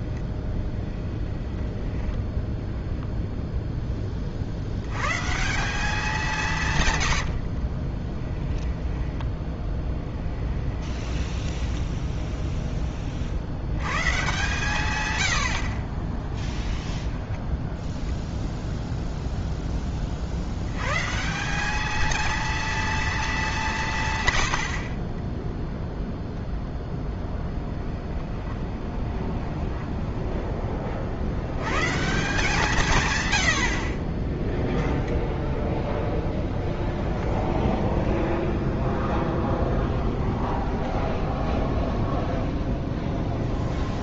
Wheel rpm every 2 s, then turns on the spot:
10, 0, 60, 150, 10, 20, 10, 140, 10, 0, 90, 230, 70, 0, 20, 20, 160, 0, 0, 0, 10, 0.
0-2 8-12 16-18 28-30 40-42